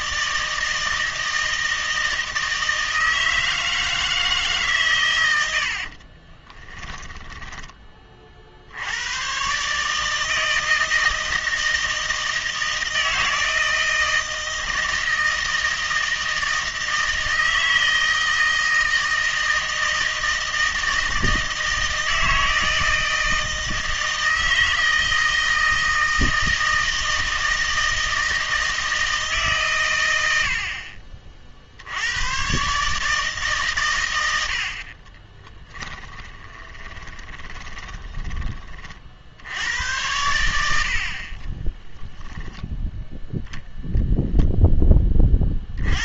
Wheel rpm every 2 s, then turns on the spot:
160, 160, 140, 10, 80, 160, 160, 160, 160, 160, 160, 160, 160, 160, 160, 50, 140, 50, 20, 40, 90, 10, 10.
6-8 36-38